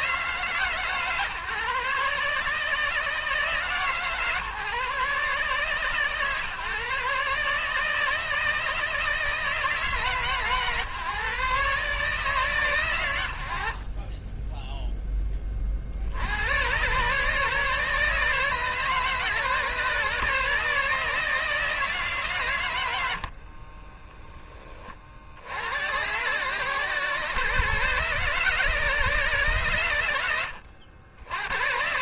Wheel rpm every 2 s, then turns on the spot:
150, 150, 140, 140, 160, 140, 120, 10, 100, 150, 150, 110, 30, 120, 140, 90.
none